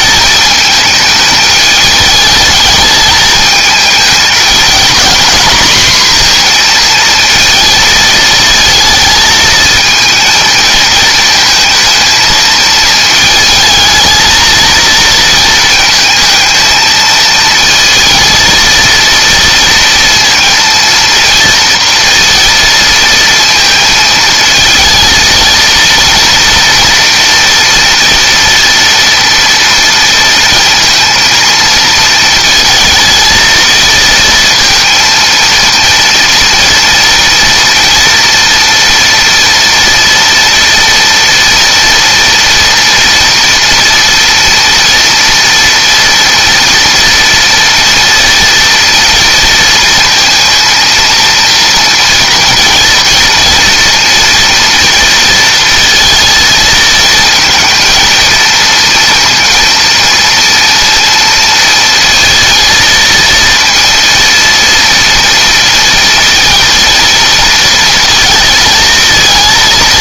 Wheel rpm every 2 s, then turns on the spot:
210, 210, 230, 230, 220, 220, 220, 230, 230, 230, 230, 230, 230, 230, 230, 230, 230, 230, 240, 240, 240, 230, 240, 240, 230, 230, 230, 230, 220, 230, 230, 230, 230, 230, 230.
none